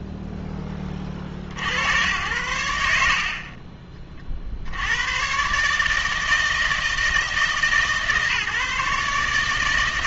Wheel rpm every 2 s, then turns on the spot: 10, 60, 60, 160, 140.
none